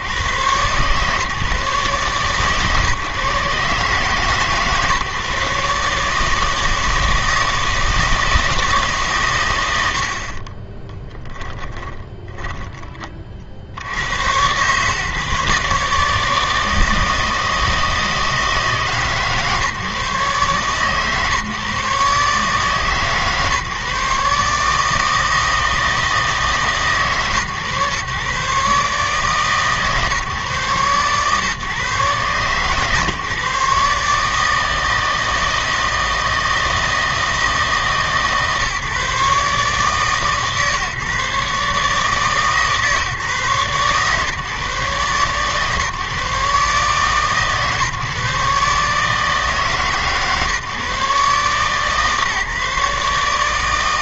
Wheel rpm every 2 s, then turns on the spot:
130, 140, 140, 160, 160, 20, 10, 120, 160, 150, 130, 140, 150, 150, 140, 130, 140, 160, 160, 140, 140, 150, 130, 140, 140, 140, 150.
10-12